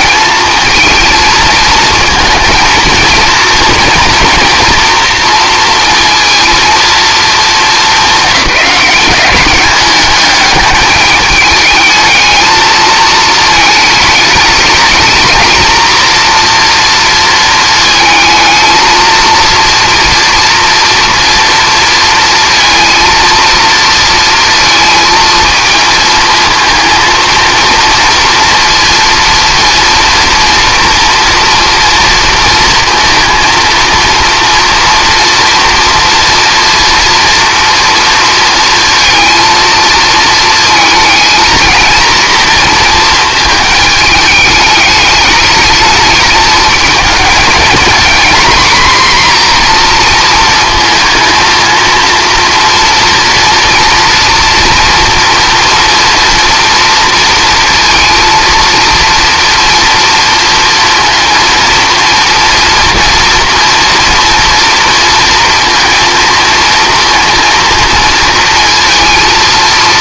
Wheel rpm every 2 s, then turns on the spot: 230, 230, 240, 230, 200, 210, 220, 220, 230, 220, 230, 230, 230, 230, 230, 230, 230, 230, 230, 230, 230, 230, 210, 220, 240, 230, 230, 230, 230, 230, 230, 230, 230, 230, 230.
none